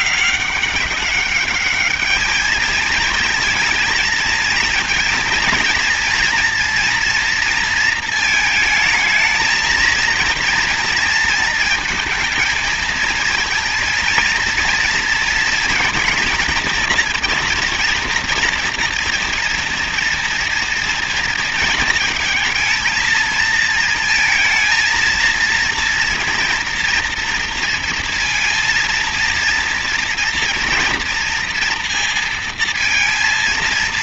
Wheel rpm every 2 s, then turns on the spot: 200, 220, 230, 230, 220, 230, 230, 230, 230, 230, 230, 230, 230, 230, 230, 230, 230.
none